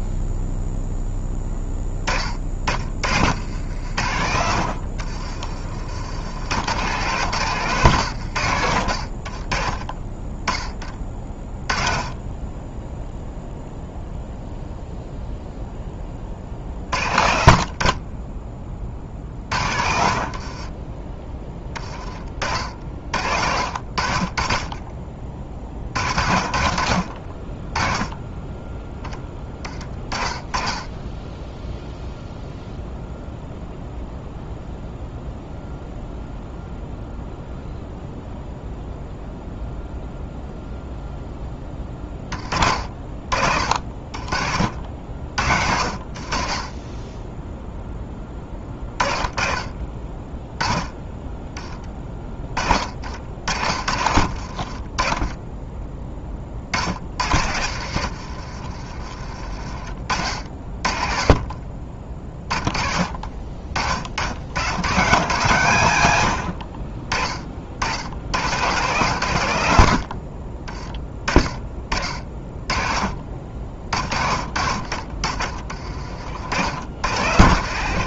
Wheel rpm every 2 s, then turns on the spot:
0, 40, 70, 110, 70, 20, 10, 0, 40, 30, 30, 60, 30, 50, 10, 20, 0, 0, 0, 0, 0, 40, 50, 40, 20, 10, 50, 50, 50, 60, 50, 30, 100, 70, 90, 30, 30, 50, 80.
2-4 20-22 58-60 74-76